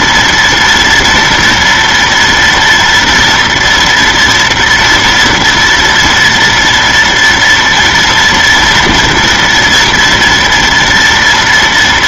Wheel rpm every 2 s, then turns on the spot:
230, 230, 230, 230, 230, 240.
none